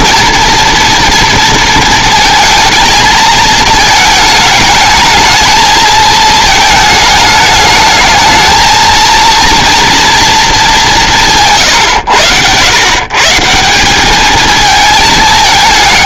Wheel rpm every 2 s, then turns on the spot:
230, 230, 220, 220, 220, 200, 130, 220.
none